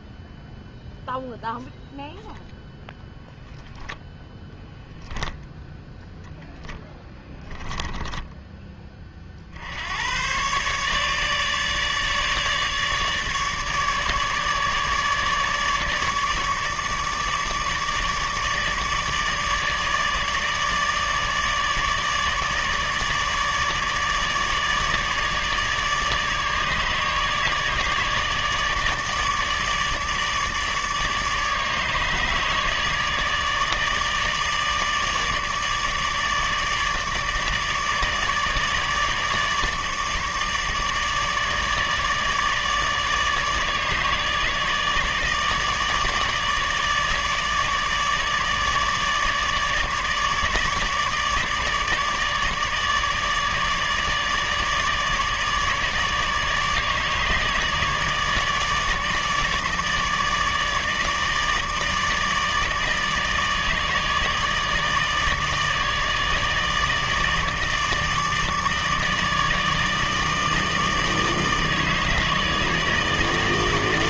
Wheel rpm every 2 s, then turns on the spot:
0, 0, 10, 0, 10, 130, 150, 150, 150, 150, 150, 150, 150, 150, 150, 150, 150, 150, 150, 150, 150, 150, 150, 150, 150, 150, 150, 150, 150, 150, 150, 160, 150, 160, 160, 160, 160.
4-6